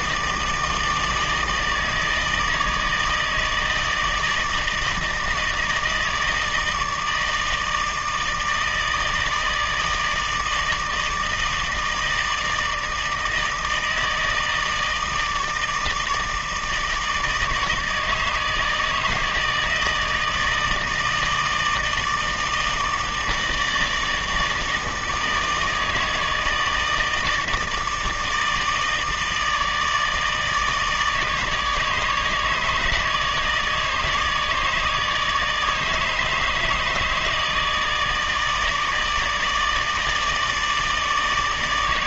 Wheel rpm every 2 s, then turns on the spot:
160, 160, 160, 160, 160, 160, 160, 160, 160, 150, 160, 160, 160, 160, 160, 150, 150, 150, 150, 160, 150.
none